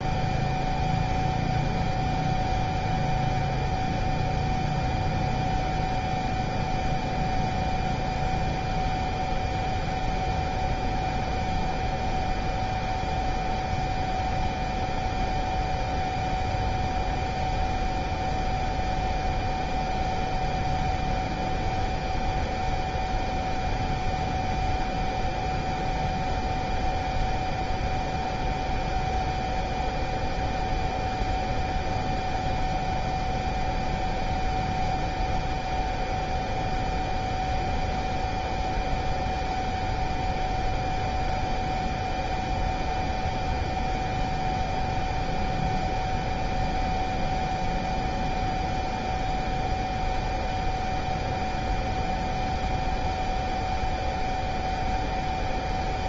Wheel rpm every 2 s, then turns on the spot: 0, 0, 0, 0, 0, 0, 0, 0, 0, 0, 0, 0, 0, 0, 0, 0, 0, 0, 0, 0, 0, 0, 0, 0, 0, 0, 0, 0.
none